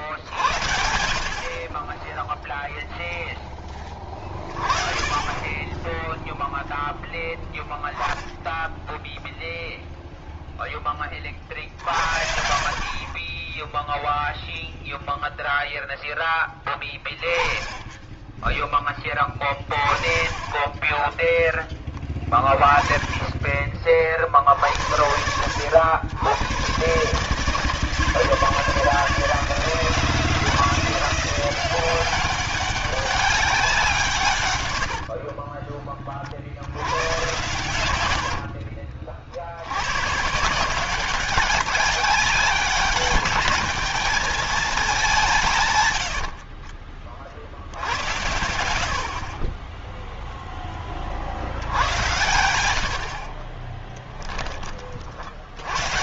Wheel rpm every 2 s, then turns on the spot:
70, 0, 30, 0, 0, 20, 40, 0, 10, 10, 20, 20, 70, 120, 160, 170, 200, 90, 90, 60, 180, 200, 200, 50, 60, 10, 80, 30.
20-22 34-36 38-40 52-54